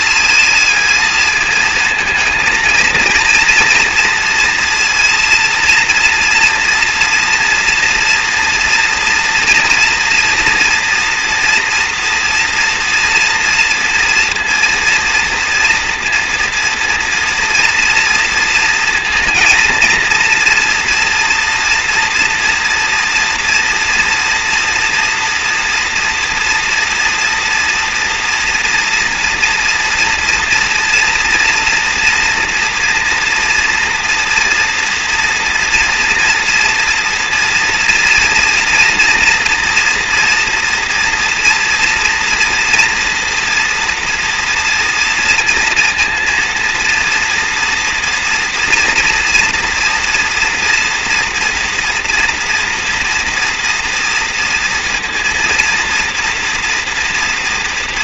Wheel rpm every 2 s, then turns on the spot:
220, 220, 230, 230, 230, 230, 230, 230, 230, 230, 230, 230, 230, 230, 240, 230, 230, 230, 230, 230, 240, 240, 230, 230, 230, 230, 230, 230, 230.
none